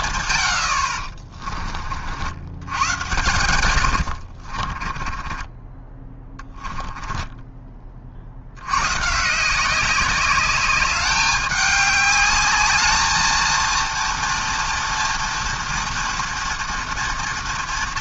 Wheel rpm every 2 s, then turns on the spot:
70, 110, 40, 10, 110, 200, 210, 230, 240.
4-8